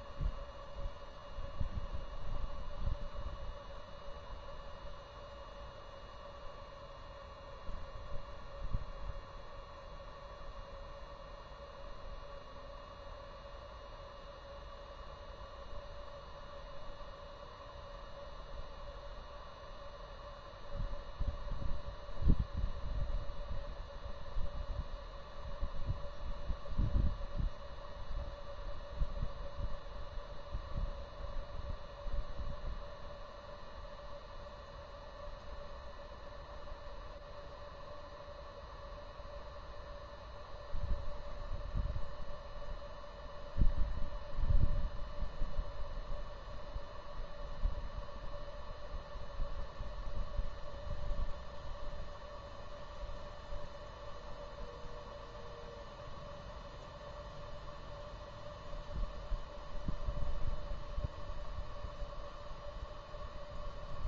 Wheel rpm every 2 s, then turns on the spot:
0, 0, 0, 0, 0, 0, 0, 0, 0, 0, 0, 0, 0, 0, 0, 0, 0, 0, 0, 0, 0, 0, 0, 0, 0, 0, 0, 0, 0, 0, 0, 0.
none